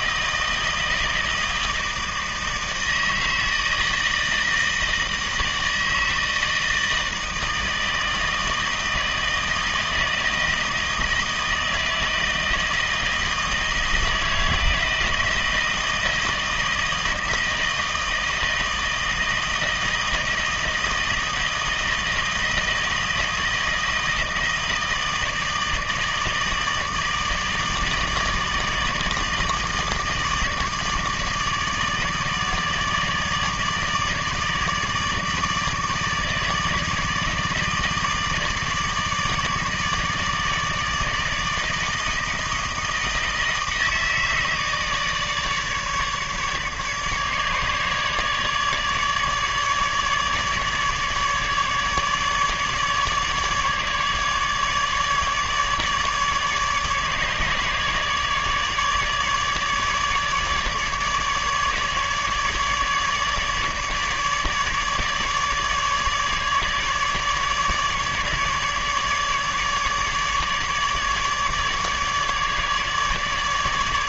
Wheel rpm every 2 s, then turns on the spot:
160, 160, 160, 160, 160, 160, 160, 160, 160, 160, 160, 160, 160, 160, 160, 160, 150, 150, 160, 160, 160, 160, 160, 150, 150, 150, 150, 150, 150, 150, 150, 150, 150, 150, 150, 150, 150.
none